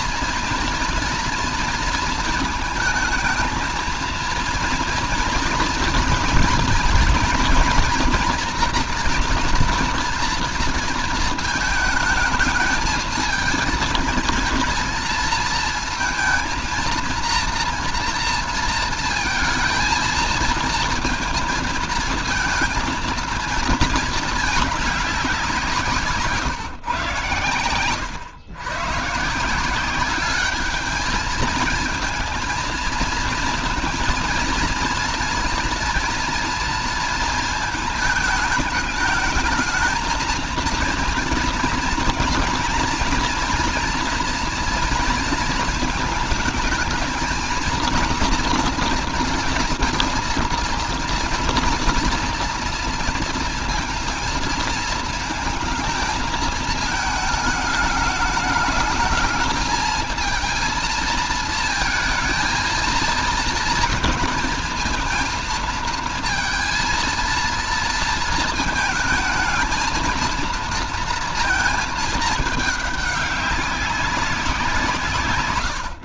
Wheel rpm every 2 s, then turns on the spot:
240, 220, 230, 230, 240, 230, 220, 220, 230, 230, 230, 230, 210, 130, 120, 210, 230, 230, 230, 210, 220, 240, 230, 220, 230, 230, 230, 220, 220, 210, 230, 230, 220, 230, 230, 230, 210, 180.
none